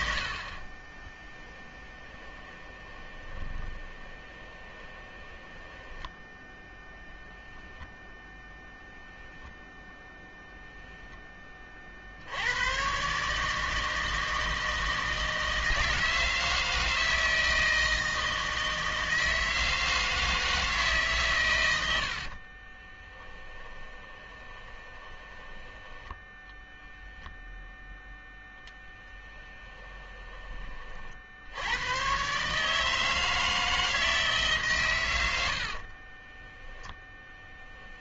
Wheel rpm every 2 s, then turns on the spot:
20, 20, 20, 10, 0, 0, 120, 160, 160, 160, 150, 20, 20, 10, 10, 40, 150, 120, 10.
0-6 22-26 28-30